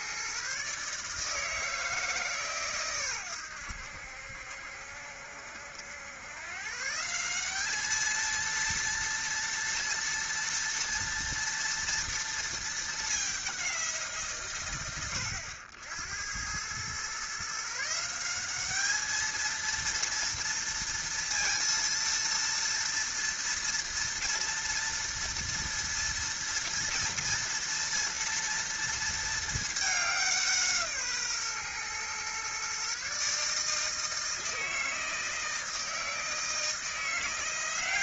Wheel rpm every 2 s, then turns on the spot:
140, 140, 70, 130, 230, 230, 230, 90, 100, 200, 230, 230, 230, 230, 230, 170, 130, 160, 160.
none